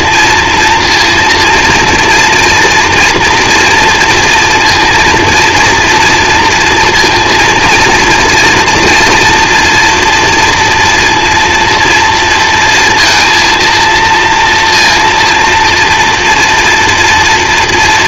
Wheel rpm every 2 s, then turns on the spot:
230, 230, 230, 240, 240, 230, 230, 230, 240.
none